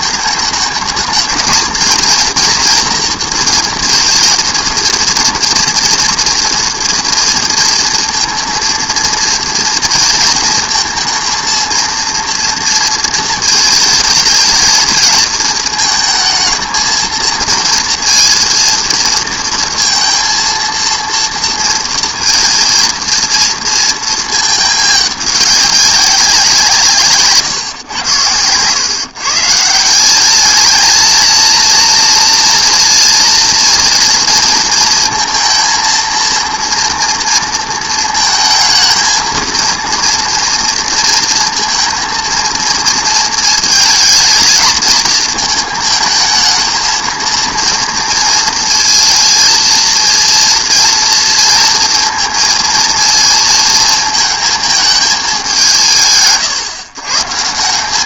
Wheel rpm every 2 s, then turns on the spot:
220, 230, 230, 230, 230, 230, 230, 220, 230, 230, 230, 230, 210, 150, 110, 220, 230, 230, 230, 230, 230, 230, 220, 220, 230, 230, 230, 220, 130.
none